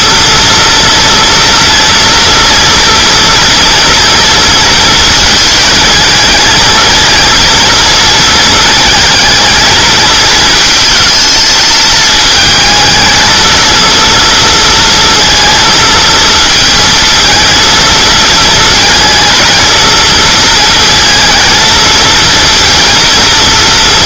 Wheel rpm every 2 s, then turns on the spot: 230, 230, 230, 220, 220, 220, 220, 230, 230, 220, 230, 230.
none